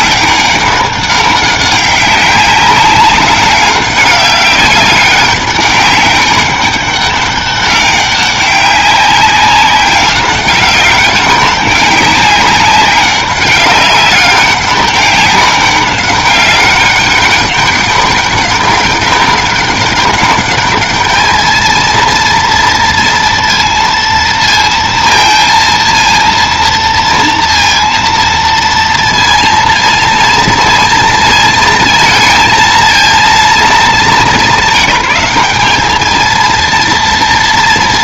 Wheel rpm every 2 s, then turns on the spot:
200, 200, 190, 200, 190, 190, 190, 200, 200, 200, 210, 230, 230, 230, 230, 230, 230, 190, 230.
none